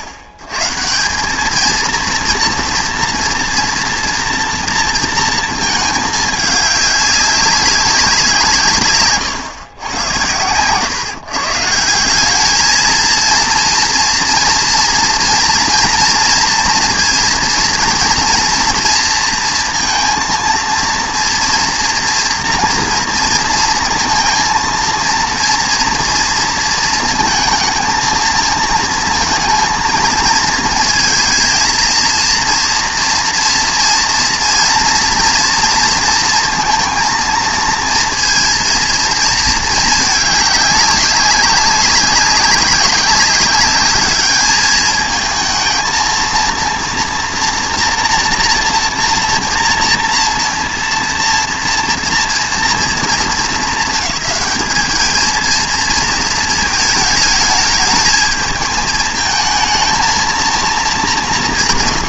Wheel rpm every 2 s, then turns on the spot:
100, 230, 230, 210, 150, 120, 220, 230, 230, 230, 230, 230, 230, 220, 220, 220, 230, 230, 230, 230, 200, 200, 210, 230, 230, 230, 230, 210, 220, 220, 230.
10-12